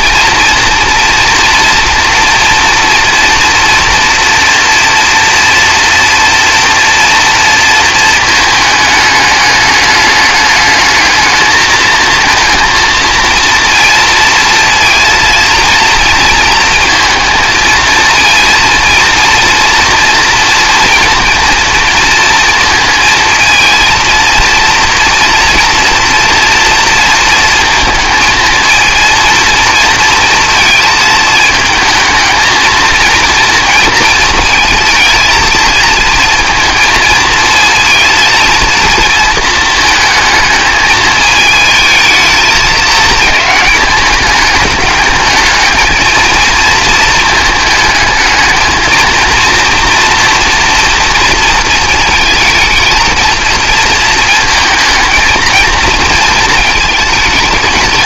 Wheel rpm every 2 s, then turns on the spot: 230, 230, 230, 230, 220, 210, 230, 230, 230, 230, 230, 230, 230, 230, 230, 220, 220, 230, 230, 230, 220, 220, 210, 230, 220, 240, 220, 230, 220.
none